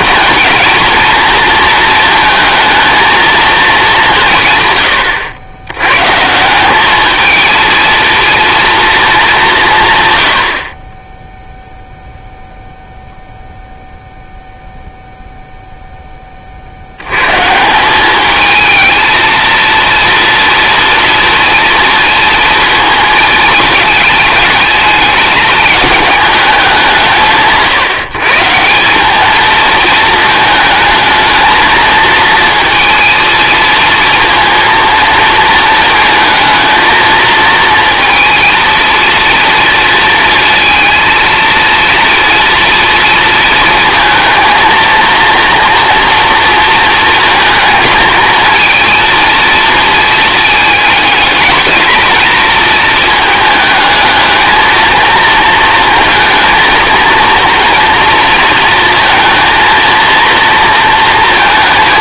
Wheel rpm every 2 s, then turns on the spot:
220, 220, 120, 190, 230, 60, 0, 0, 50, 220, 230, 230, 220, 200, 160, 220, 230, 230, 220, 230, 230, 230, 230, 230, 230, 220, 220, 220, 230, 230, 230.
none